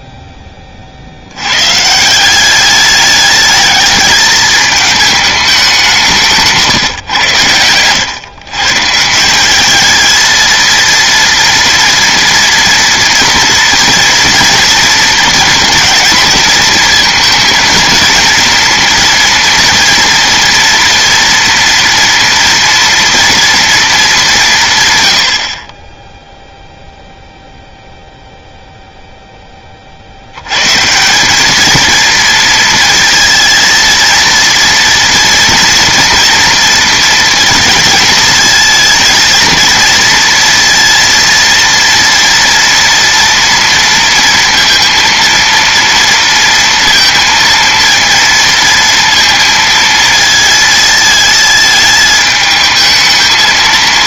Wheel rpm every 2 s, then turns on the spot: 20, 200, 220, 160, 140, 230, 230, 230, 220, 230, 230, 230, 160, 0, 10, 180, 230, 230, 230, 220, 230, 230, 230, 230, 230, 220, 210.
none